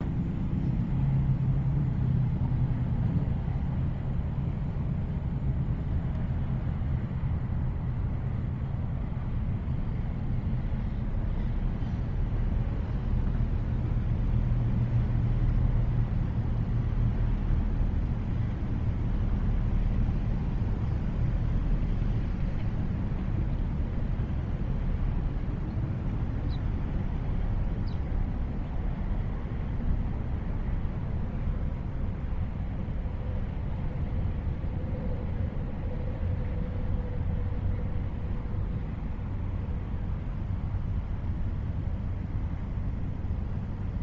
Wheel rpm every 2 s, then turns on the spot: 0, 0, 0, 0, 0, 0, 0, 0, 0, 0, 0, 0, 0, 0, 0, 0, 0, 0, 0, 0, 0, 0.
none